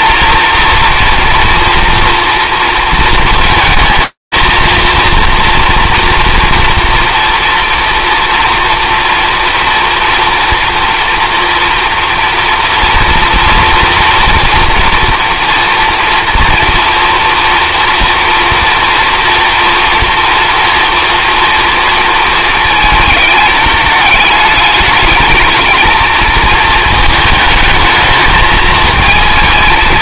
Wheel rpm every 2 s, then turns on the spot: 230, 230, 230, 230, 230, 230, 230, 230, 230, 240, 230, 210, 210, 220, 220.
none